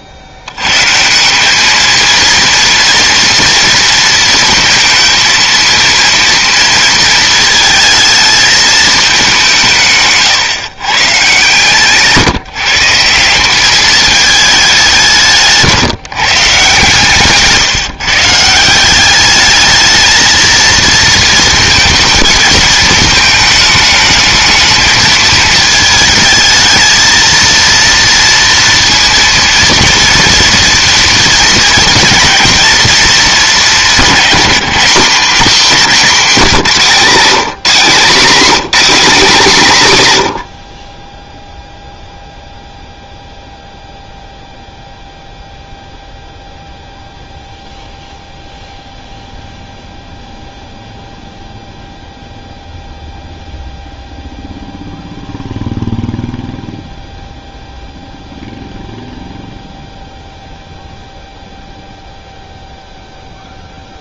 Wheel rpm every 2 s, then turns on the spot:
70, 230, 230, 230, 220, 130, 160, 200, 150, 170, 230, 220, 220, 220, 230, 230, 230, 220, 190, 260, 50, 0, 0, 0, 0, 0, 0, 0, 0, 0, 0, 0.
36-38